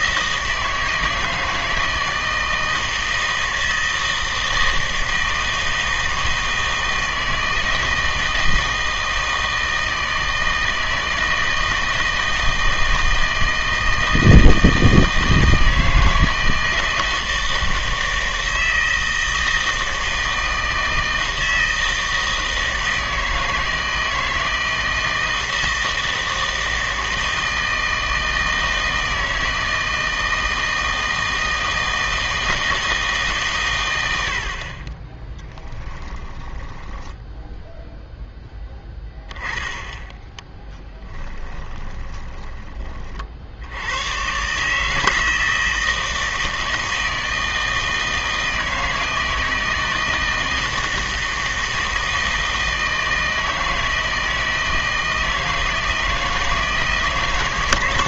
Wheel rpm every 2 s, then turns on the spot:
160, 160, 160, 160, 160, 160, 160, 160, 160, 160, 160, 160, 160, 160, 160, 160, 160, 50, 10, 10, 10, 30, 150, 160, 160, 160, 160, 160, 160.
36-38 40-44